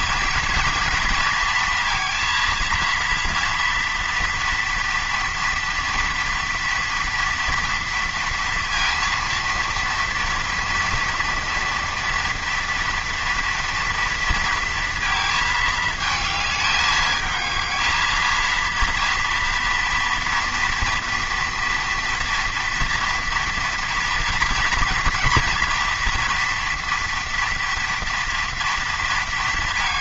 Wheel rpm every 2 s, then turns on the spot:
230, 230, 230, 230, 230, 230, 230, 230, 220, 230, 230, 230, 230, 230, 230.
none